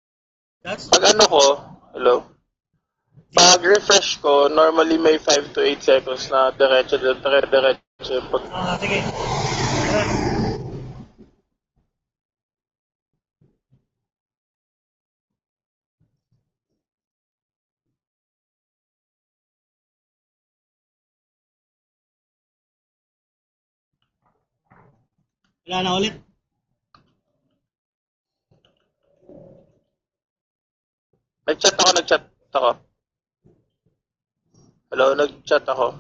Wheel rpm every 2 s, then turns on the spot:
0, 0, 0, 0, 0, 0, 0, 0, 0, 0, 0, 0, 0, 0, 0, 0, 0, 0.
none